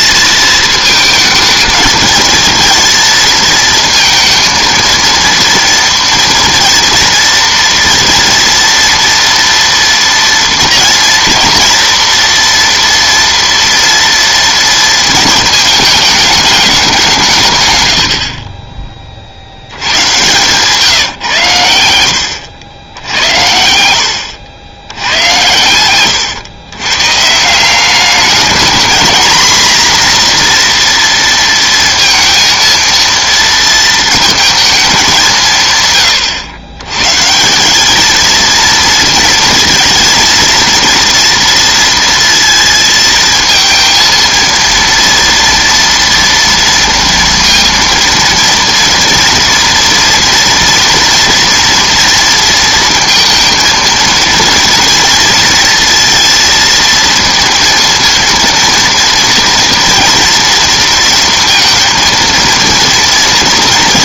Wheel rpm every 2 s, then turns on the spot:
220, 220, 230, 230, 230, 230, 240, 230, 200, 30, 130, 80, 80, 120, 210, 240, 230, 230, 110, 220, 230, 230, 230, 230, 230, 230, 230, 230, 230, 230, 230, 230.
18-20